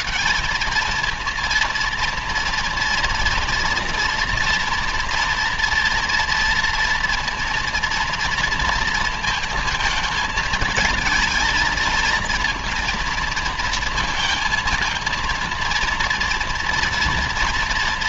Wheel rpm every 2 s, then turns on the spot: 230, 230, 230, 230, 230, 220, 230, 230, 230.
none